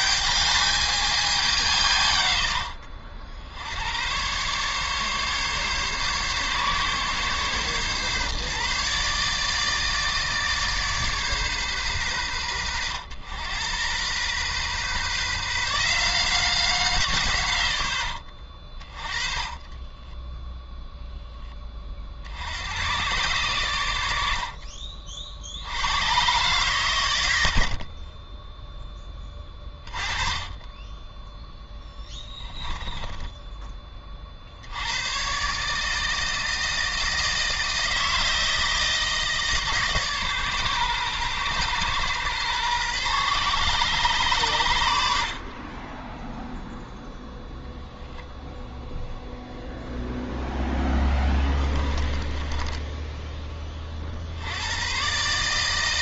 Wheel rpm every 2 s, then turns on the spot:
210, 60, 140, 140, 150, 150, 80, 130, 160, 30, 0, 110, 50, 120, 10, 10, 10, 90, 160, 160, 120, 130, 90, 0, 0, 10, 10, 120.
18-20 32-34 50-54